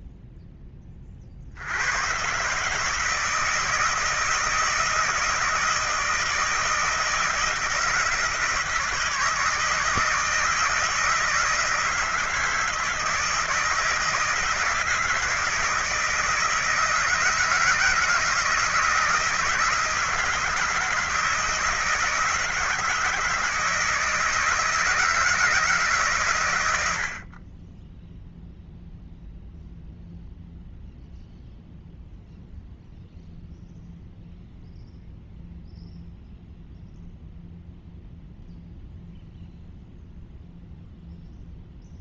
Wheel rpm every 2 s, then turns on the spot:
40, 160, 160, 160, 160, 160, 160, 160, 160, 160, 160, 160, 160, 70, 0, 0, 0, 0, 0, 0, 0.
none